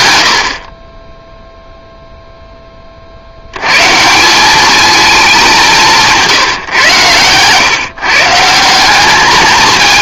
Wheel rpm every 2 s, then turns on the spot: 40, 10, 210, 150, 170.
6-8